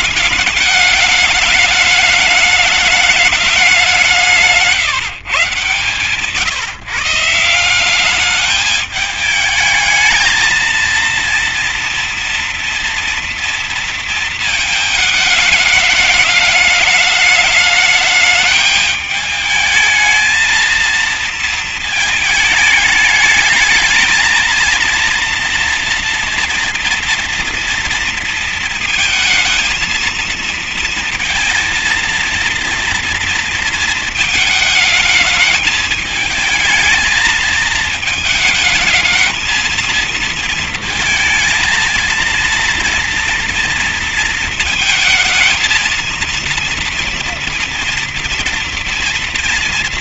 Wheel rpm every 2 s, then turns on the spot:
210, 210, 180, 130, 210, 220, 230, 220, 210, 210, 220, 220, 220, 230, 230, 230, 230, 220, 220, 220, 230, 230, 230, 230, 230.
none